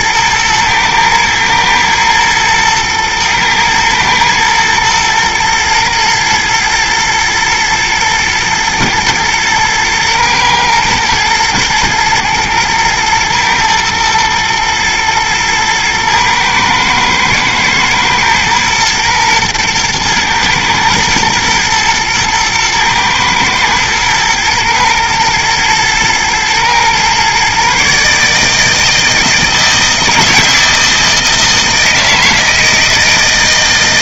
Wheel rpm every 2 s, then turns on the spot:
110, 110, 110, 110, 110, 110, 110, 110, 110, 120, 110, 110, 120, 120, 160, 160, 160.
none